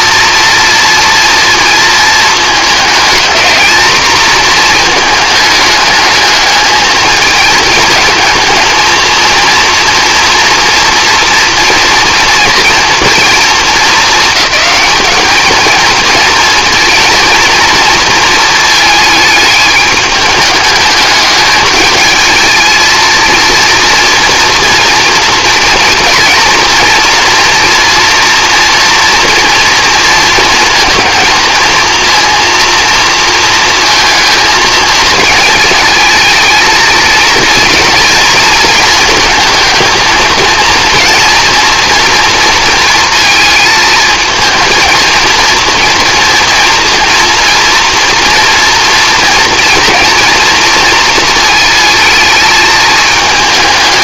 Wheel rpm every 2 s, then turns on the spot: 230, 210, 220, 220, 230, 230, 230, 220, 230, 220, 210, 220, 230, 230, 230, 220, 230, 220, 230, 230, 230, 230, 220, 230, 230, 230, 220.
none